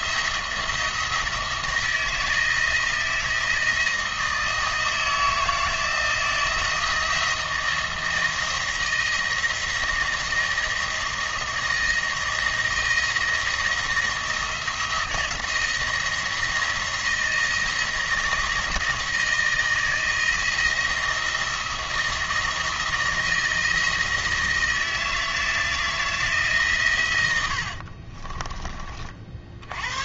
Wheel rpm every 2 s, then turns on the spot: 170, 160, 160, 170, 170, 160, 170, 170, 170, 170, 170, 170, 160, 130, 30.
none